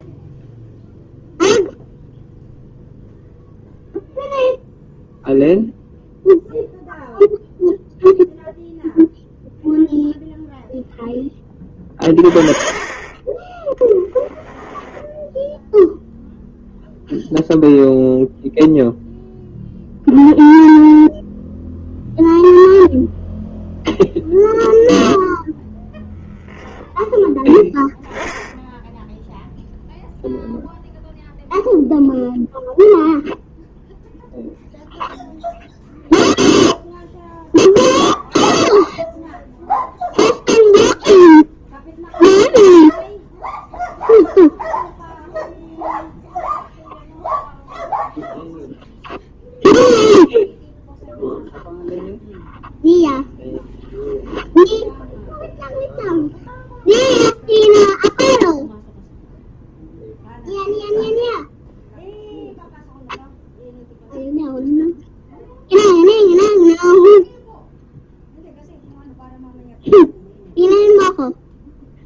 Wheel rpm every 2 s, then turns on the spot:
0, 0, 0, 0, 0, 0, 20, 10, 0, 0, 0, 0, 0, 10, 10, 0, 0, 0, 0, 0, 0, 0, 0, 0, 0, 0, 0, 0, 0, 0, 0, 0, 0, 0, 0, 0.
12-16